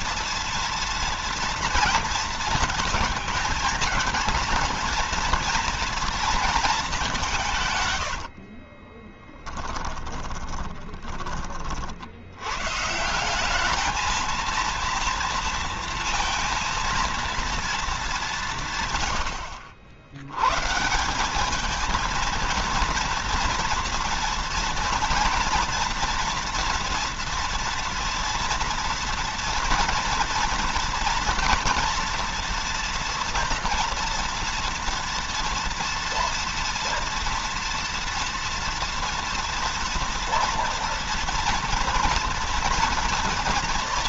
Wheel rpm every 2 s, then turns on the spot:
230, 230, 230, 220, 40, 20, 130, 230, 230, 150, 140, 230, 230, 230, 230, 230, 230, 230, 230, 230, 230, 230.
8-12